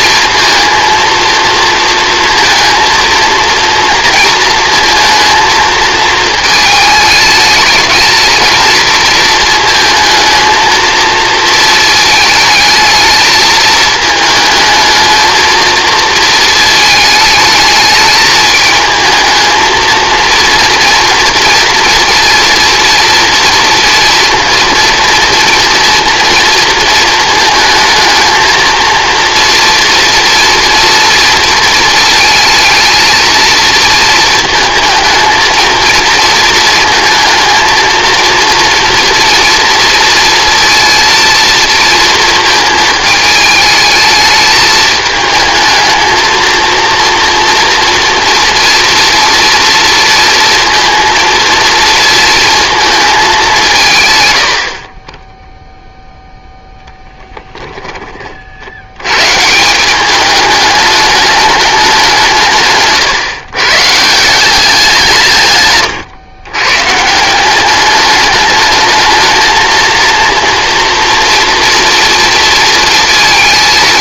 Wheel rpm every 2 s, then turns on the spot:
230, 230, 230, 220, 230, 230, 220, 220, 220, 220, 230, 230, 230, 230, 230, 230, 230, 220, 230, 240, 230, 220, 220, 230, 230, 230, 230, 40, 0, 80, 210, 140, 190, 130, 220, 230, 230.
none